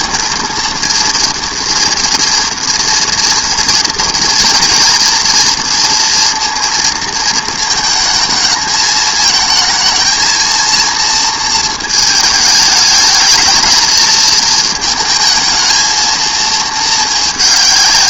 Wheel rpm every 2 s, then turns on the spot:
230, 230, 230, 230, 220, 230, 210, 220, 220.
none